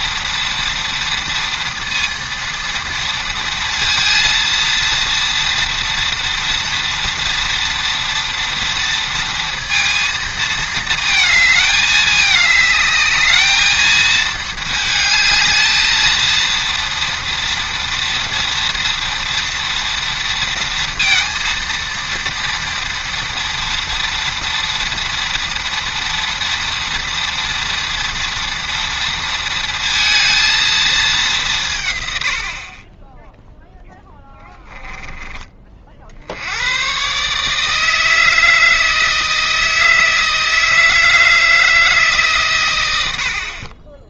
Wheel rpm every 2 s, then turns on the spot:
230, 230, 230, 230, 230, 220, 210, 220, 230, 240, 230, 240, 230, 230, 230, 220, 30, 10, 120, 160, 160, 90.
none